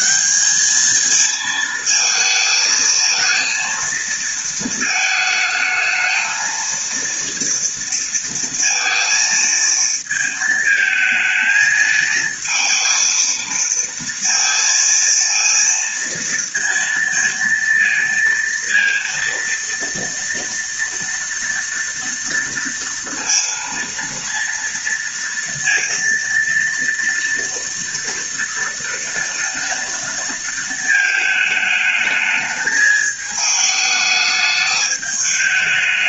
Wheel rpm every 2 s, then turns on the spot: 220, 230, 220, 230, 230, 220, 230, 230, 230, 230, 230, 230, 230, 230, 230, 220, 220, 210.
none